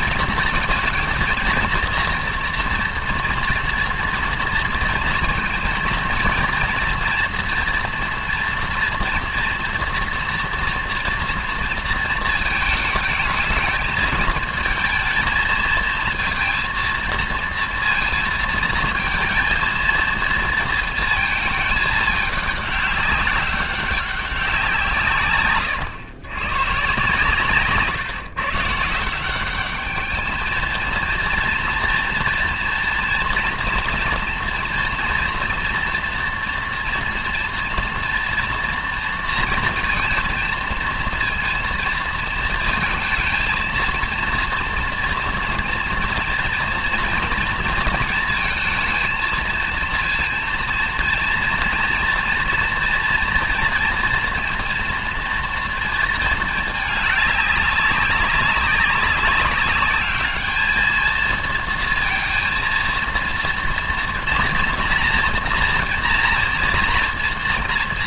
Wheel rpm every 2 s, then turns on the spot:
230, 240, 230, 230, 240, 230, 220, 220, 230, 220, 230, 200, 170, 130, 150, 220, 230, 240, 240, 230, 230, 220, 240, 230, 230, 230, 230, 230, 220, 200, 220, 230, 230, 230.
none